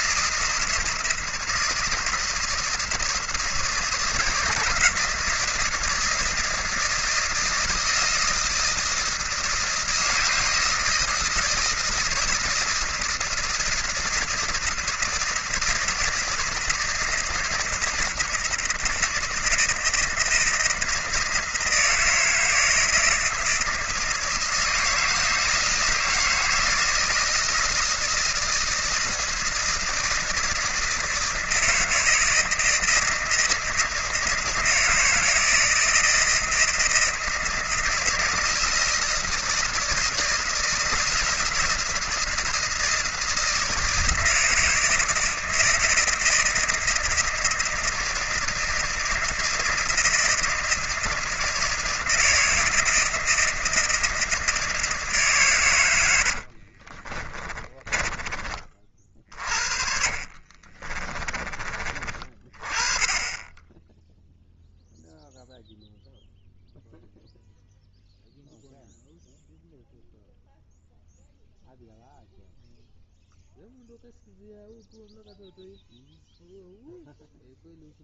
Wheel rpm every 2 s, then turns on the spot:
160, 160, 160, 160, 160, 160, 160, 160, 160, 160, 160, 170, 160, 160, 160, 160, 160, 160, 160, 160, 160, 170, 160, 160, 160, 160, 160, 150, 30, 50, 30, 30, 0, 0, 0, 0, 0, 0, 0.
56-62